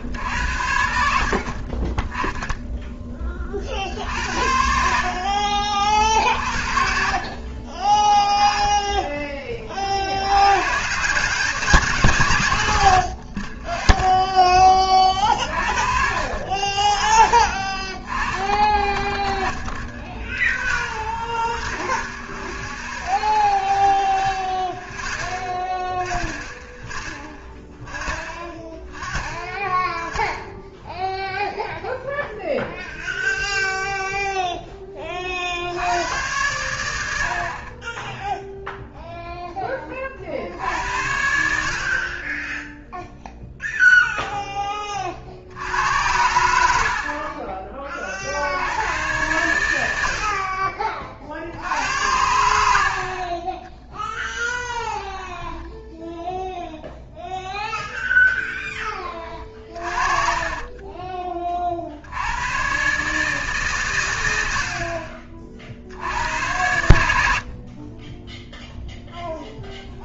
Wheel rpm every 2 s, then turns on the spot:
30, 20, 70, 50, 10, 90, 110, 20, 50, 20, 0, 0, 0, 0, 0, 0, 0, 40, 60, 0, 70, 0, 30, 60, 100, 30, 60, 10, 0, 20, 30, 130, 60, 90, 0.
54-56 60-62